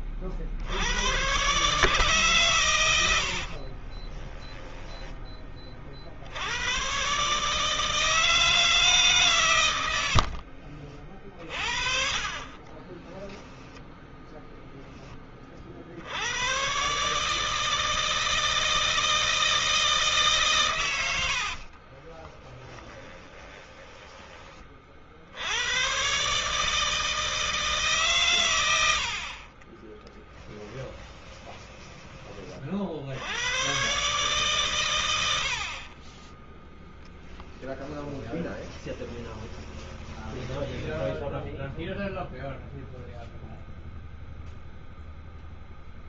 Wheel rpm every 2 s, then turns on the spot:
50, 130, 20, 70, 160, 70, 40, 10, 90, 160, 140, 30, 20, 130, 120, 10, 30, 130, 20, 10, 20, 0, 0.
4-6 10-14 22-24 38-42